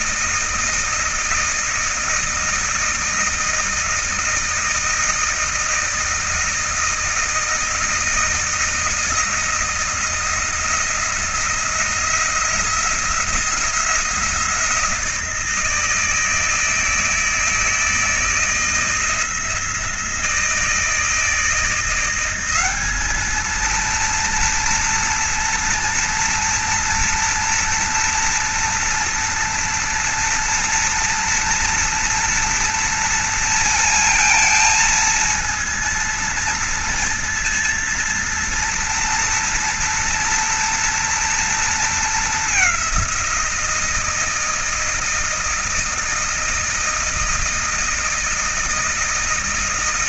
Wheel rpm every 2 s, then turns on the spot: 160, 160, 160, 160, 160, 170, 170, 170, 160, 160, 160, 210, 230, 230, 230, 230, 230, 230, 230, 240, 230, 190, 160, 160, 160.
none